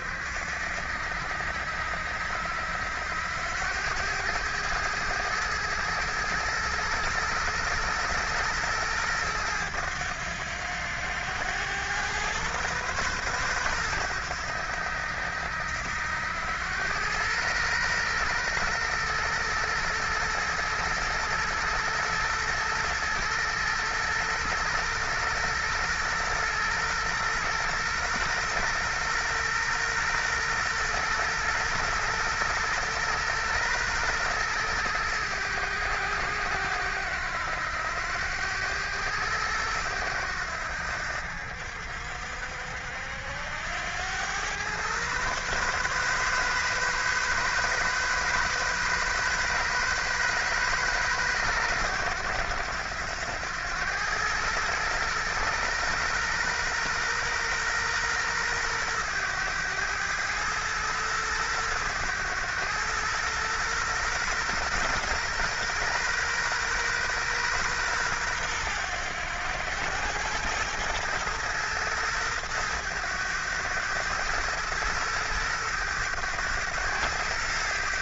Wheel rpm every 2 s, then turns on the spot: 70, 80, 110, 110, 110, 90, 120, 90, 100, 120, 110, 110, 120, 120, 120, 120, 120, 110, 90, 100, 80, 70, 120, 130, 130, 120, 100, 110, 120, 110, 110, 110, 120, 130, 100, 110, 110, 110, 100.
none